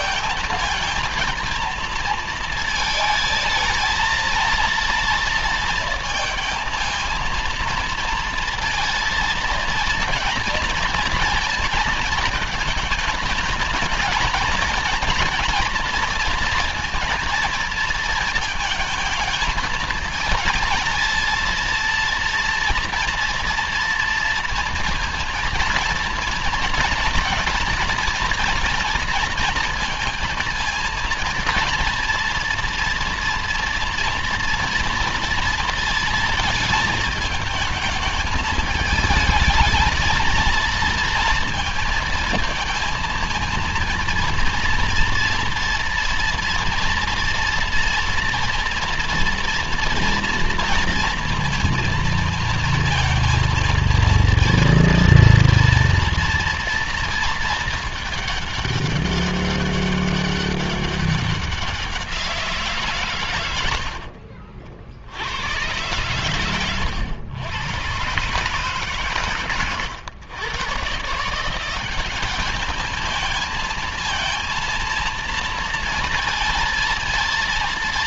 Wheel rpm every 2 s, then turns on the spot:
230, 220, 230, 230, 230, 230, 220, 230, 230, 220, 230, 240, 230, 230, 230, 230, 230, 230, 220, 220, 230, 230, 230, 230, 230, 230, 220, 230, 230, 200, 190, 130, 90, 120, 130, 150, 220, 230, 230.
none